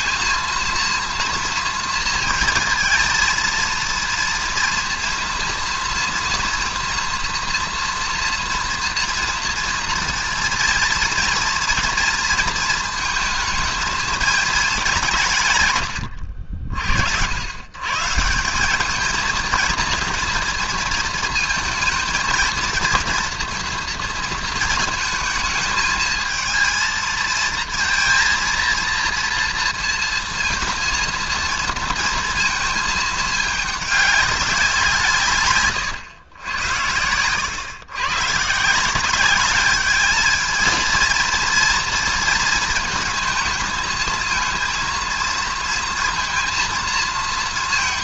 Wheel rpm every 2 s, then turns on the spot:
230, 230, 230, 230, 230, 230, 230, 210, 60, 210, 230, 230, 220, 230, 230, 230, 220, 170, 100, 170, 230, 220, 230, 220.
none